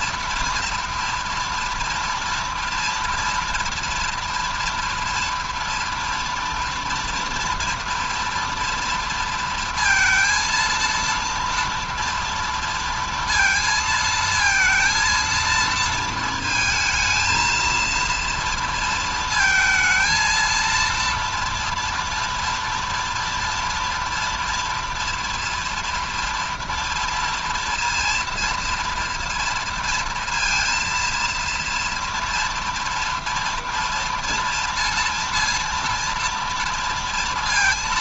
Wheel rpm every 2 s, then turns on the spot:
230, 230, 230, 230, 230, 230, 230, 230, 220, 230, 230, 230, 230, 230, 230, 230, 230, 230, 230.
none